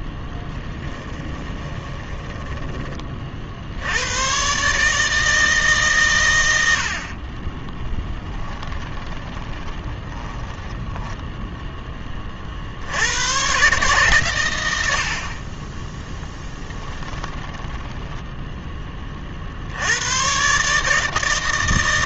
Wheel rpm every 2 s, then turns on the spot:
10, 30, 150, 60, 10, 10, 60, 90, 10, 10, 150.
0-2 8-12 16-18